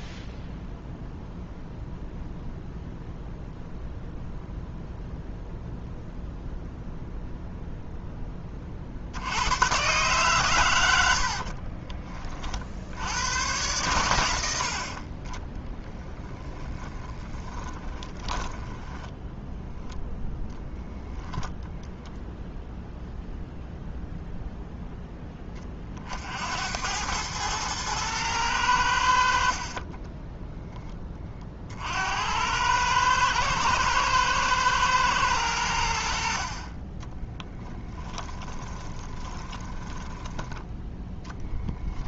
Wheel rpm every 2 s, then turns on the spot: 0, 0, 0, 0, 50, 80, 80, 50, 20, 10, 10, 0, 0, 90, 80, 10, 110, 120, 40, 20, 10.
16-20 38-40